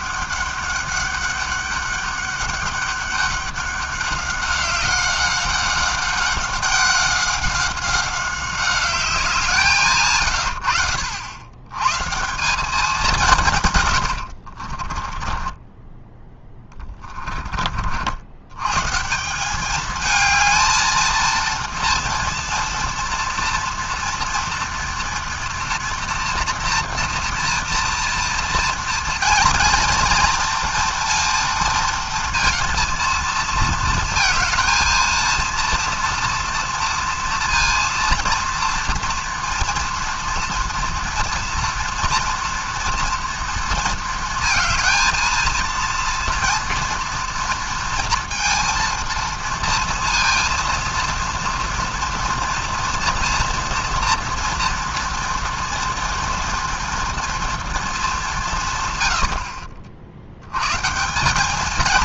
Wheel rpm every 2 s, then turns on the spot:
200, 200, 190, 190, 190, 80, 190, 50, 10, 110, 220, 240, 230, 240, 230, 230, 230, 230, 230, 230, 240, 240, 220, 230, 230, 230, 230, 230, 230, 170, 110.
14-18